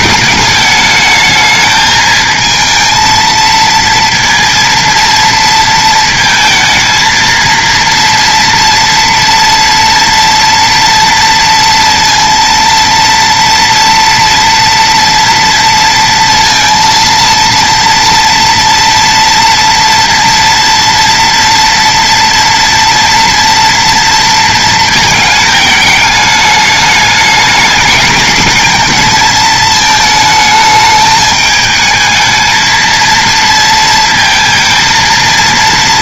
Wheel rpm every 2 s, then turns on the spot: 210, 230, 230, 220, 240, 230, 230, 230, 230, 230, 230, 230, 230, 210, 220, 220, 220, 230.
none